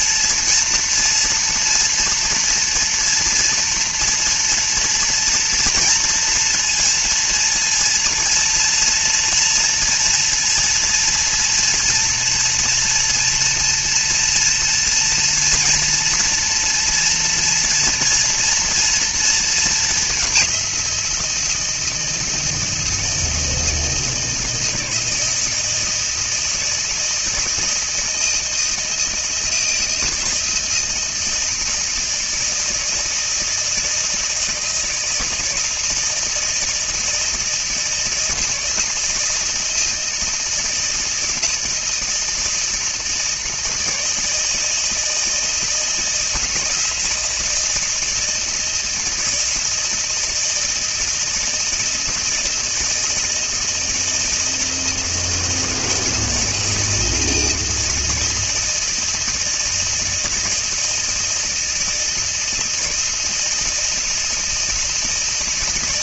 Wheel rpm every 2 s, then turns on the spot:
230, 230, 230, 230, 230, 230, 230, 230, 230, 230, 180, 160, 160, 160, 160, 160, 160, 160, 160, 160, 160, 160, 160, 160, 160, 160, 160, 160, 160, 160, 160, 160, 160.
none